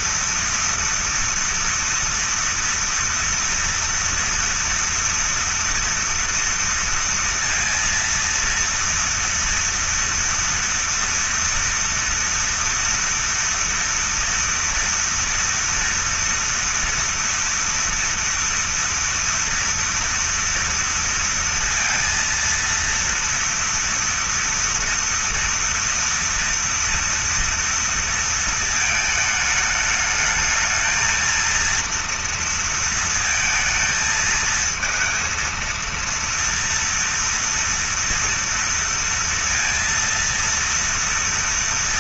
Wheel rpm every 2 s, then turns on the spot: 230, 230, 230, 230, 230, 230, 230, 230, 230, 230, 230, 230, 230, 240, 220, 220, 230, 230, 230, 230, 230.
none